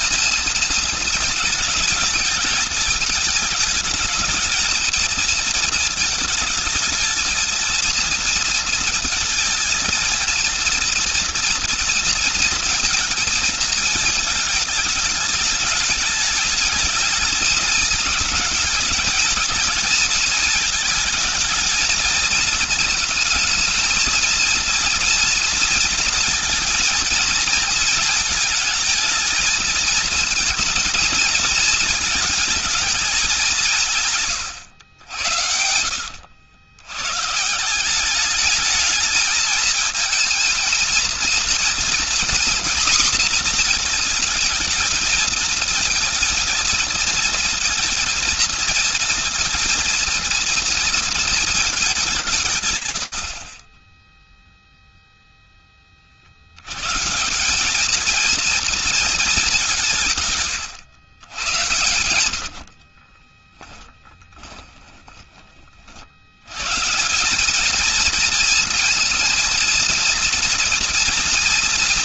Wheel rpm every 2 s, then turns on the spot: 230, 220, 220, 220, 230, 230, 240, 220, 210, 220, 220, 230, 230, 230, 220, 220, 220, 130, 90, 210, 230, 240, 230, 220, 230, 230, 150, 0, 80, 230, 120, 60, 10, 150, 230, 240.
34-36 62-66